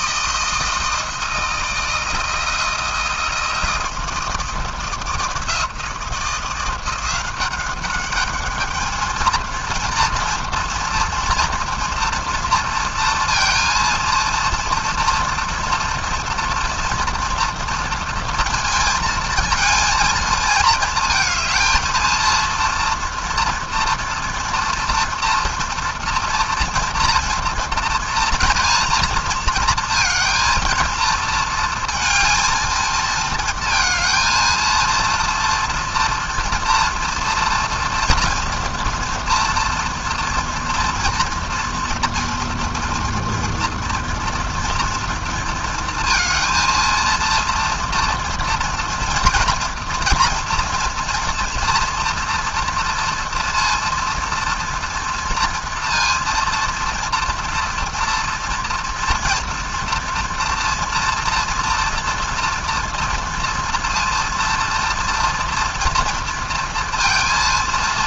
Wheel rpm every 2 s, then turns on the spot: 160, 160, 160, 170, 210, 230, 230, 230, 240, 230, 220, 230, 230, 230, 230, 230, 230, 230, 230, 240, 230, 230, 230, 230, 240, 230, 230, 230, 230, 230, 230, 230, 230, 230.
none